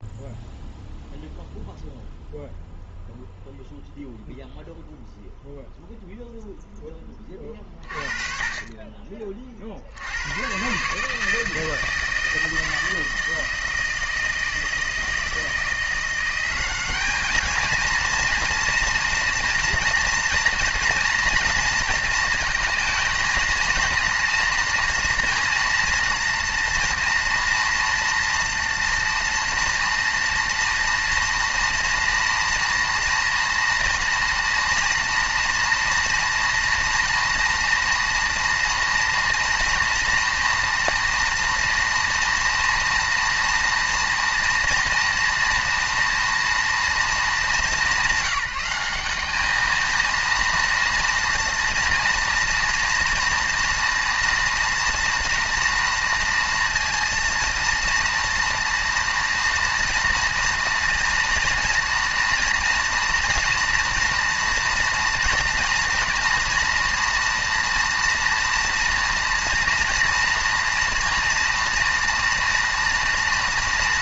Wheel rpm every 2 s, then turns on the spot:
0, 0, 0, 0, 30, 120, 160, 160, 190, 230, 230, 230, 230, 230, 230, 230, 230, 230, 230, 230, 230, 230, 230, 230, 190, 230, 240, 230, 230, 230, 230, 230, 230, 240, 240, 240, 230.
none